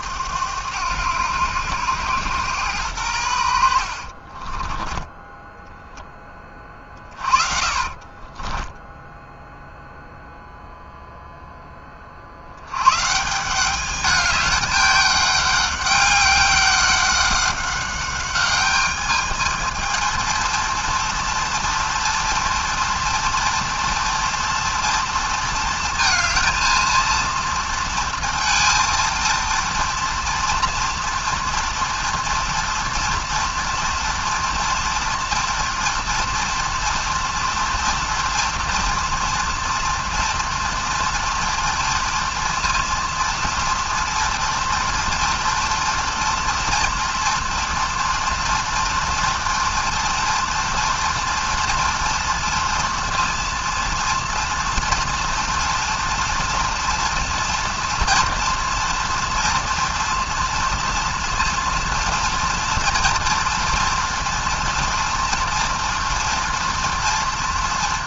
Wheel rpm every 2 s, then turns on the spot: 100, 110, 20, 30, 10, 0, 100, 210, 200, 210, 230, 240, 230, 230, 230, 230, 240, 230, 230, 230, 240, 230, 230, 240, 240, 230, 230, 230, 230, 230, 230, 240, 230, 230.
4-10